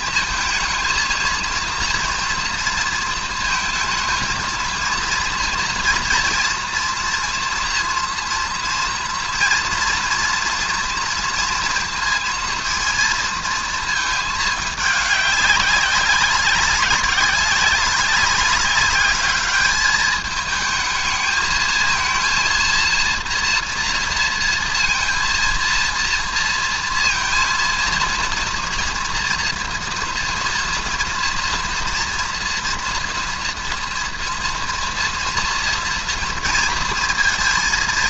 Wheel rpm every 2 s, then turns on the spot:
230, 230, 230, 230, 230, 240, 230, 210, 190, 200, 220, 230, 230, 230, 230, 230, 230, 230, 230.
none